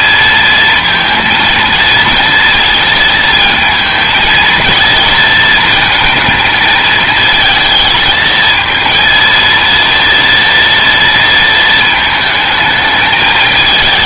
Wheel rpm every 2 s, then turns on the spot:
230, 220, 230, 220, 230, 230, 220.
none